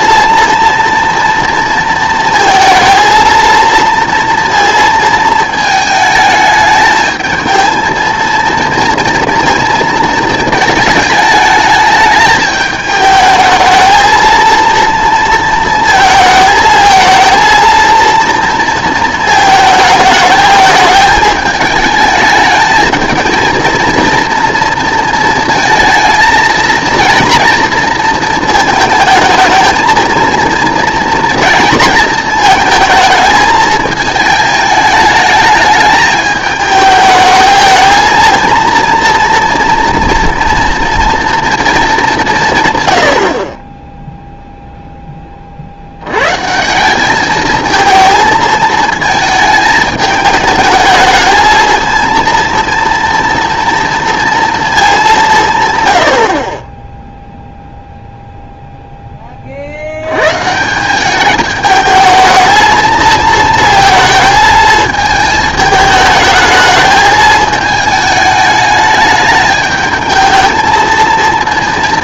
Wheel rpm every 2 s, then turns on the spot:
230, 230, 230, 220, 230, 220, 210, 230, 220, 230, 210, 220, 230, 230, 220, 230, 220, 220, 220, 230, 230, 130, 0, 170, 220, 210, 230, 220, 10, 0, 160, 220, 220, 220, 210, 220.
none